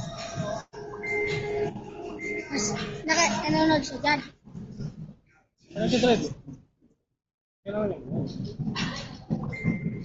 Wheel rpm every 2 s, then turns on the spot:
0, 0, 0, 0, 0.
none